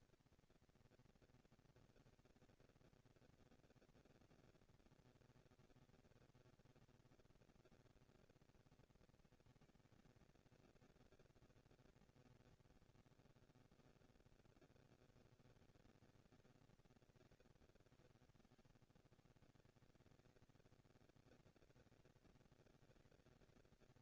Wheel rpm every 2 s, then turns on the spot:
230, 230, 230, 230, 230, 230, 200, 110, 170, 110, 190, 220.
none